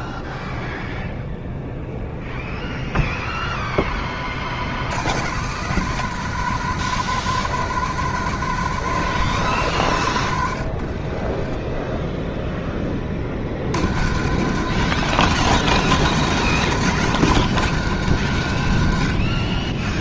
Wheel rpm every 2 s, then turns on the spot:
0, 0, 100, 150, 150, 40, 30, 140, 140, 110.
10-12